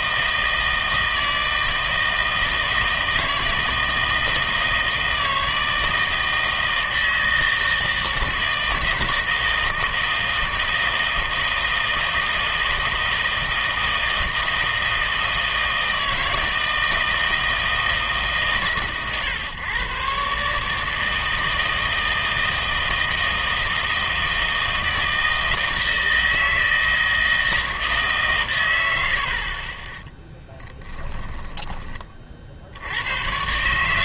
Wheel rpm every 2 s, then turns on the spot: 160, 160, 160, 160, 160, 160, 160, 160, 160, 130, 150, 160, 160, 160, 110, 10, 70.
30-32